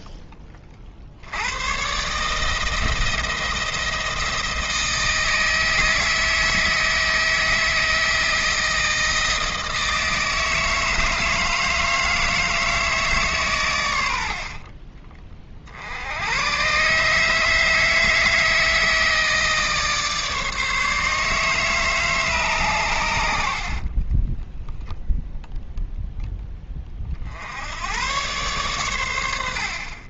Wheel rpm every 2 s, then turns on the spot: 40, 160, 160, 160, 160, 160, 160, 40, 130, 160, 150, 120, 10, 20, 120.
14-16